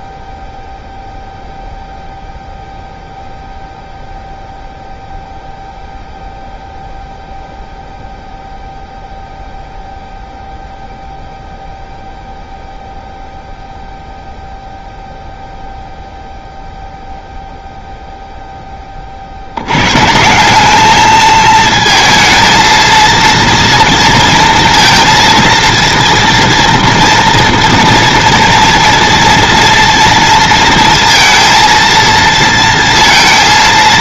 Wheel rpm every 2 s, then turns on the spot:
0, 0, 0, 0, 0, 0, 0, 0, 0, 20, 200, 230, 230, 230, 230, 230, 230.
none